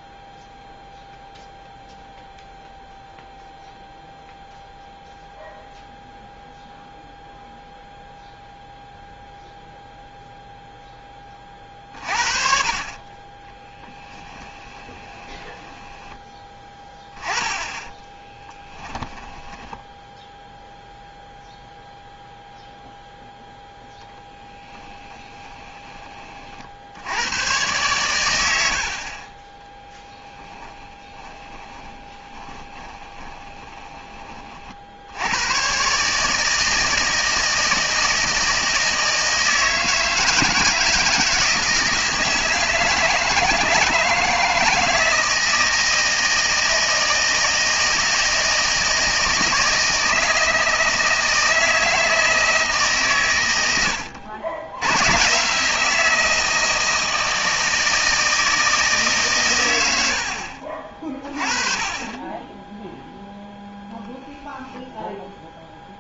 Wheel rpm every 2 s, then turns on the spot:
0, 0, 0, 0, 0, 10, 40, 20, 10, 10, 0, 0, 10, 60, 70, 10, 20, 60, 160, 160, 160, 160, 160, 160, 160, 160, 130, 100, 160, 160, 40, 10, 0.
14-16 18-20 24-26 30-34